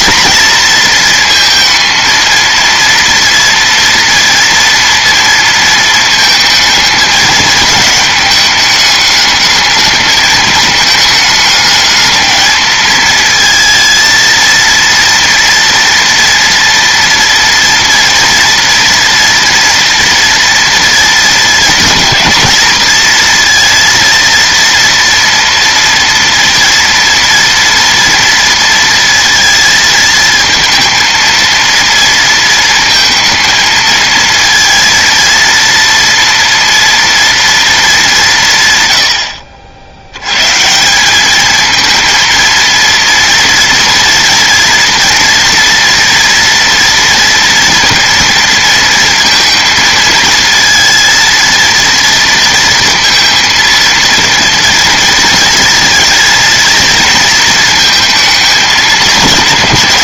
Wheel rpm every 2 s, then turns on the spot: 230, 230, 230, 220, 210, 210, 220, 230, 230, 230, 230, 230, 230, 230, 230, 230, 230, 230, 230, 110, 170, 230, 230, 240, 230, 230, 230, 230, 230, 210.
none